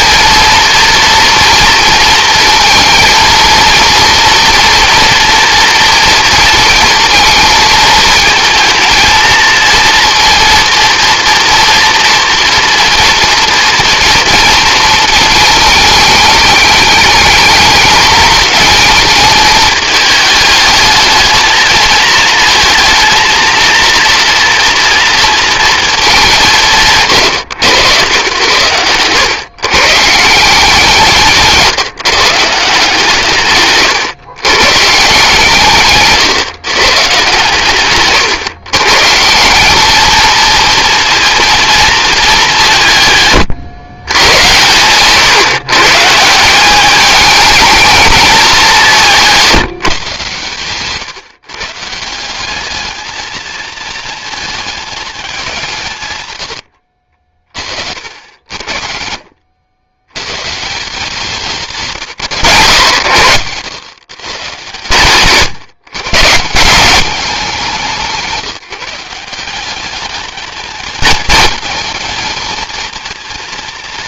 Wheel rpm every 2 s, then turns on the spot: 230, 230, 230, 230, 220, 240, 230, 230, 210, 220, 220, 230, 230, 140, 100, 180, 150, 130, 120, 140, 230, 160, 120, 200, 190, 130, 210, 210, 70, 70, 170, 120, 120, 190, 160, 220, 230.
56-60